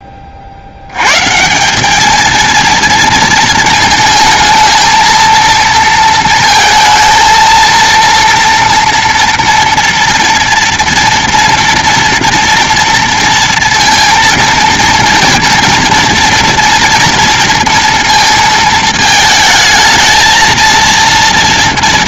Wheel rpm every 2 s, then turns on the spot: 50, 220, 220, 230, 230, 230, 230, 230, 230, 230, 230.
none